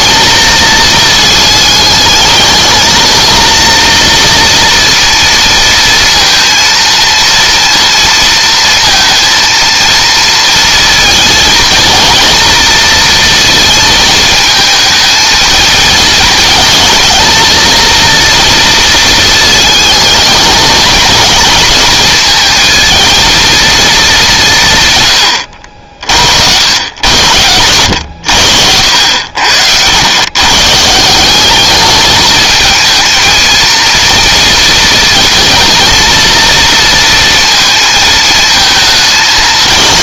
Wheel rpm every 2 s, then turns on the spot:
220, 220, 230, 230, 230, 220, 220, 220, 220, 230, 230, 230, 130, 100, 80, 150, 220, 230, 230, 220.
none